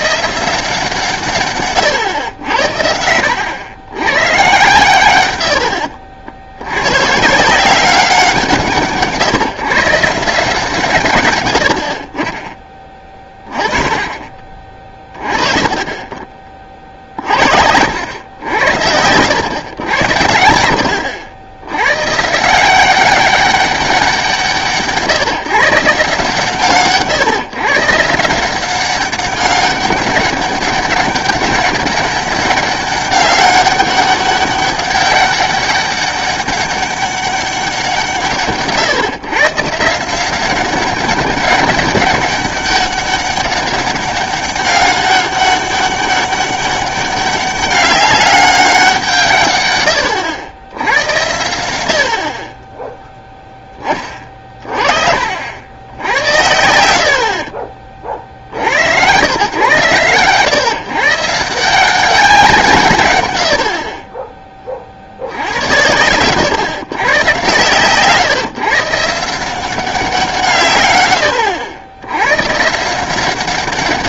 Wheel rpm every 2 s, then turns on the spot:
160, 80, 110, 90, 160, 160, 20, 30, 40, 80, 80, 170, 170, 150, 180, 200, 200, 200, 200, 150, 190, 200, 200, 200, 200, 90, 20, 40, 80, 70, 130, 170, 20, 120, 150, 140, 140.
none